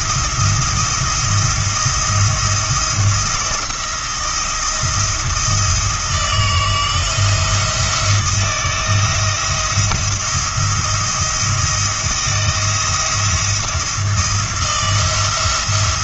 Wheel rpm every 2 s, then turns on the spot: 170, 170, 170, 170, 170, 170, 170, 170.
none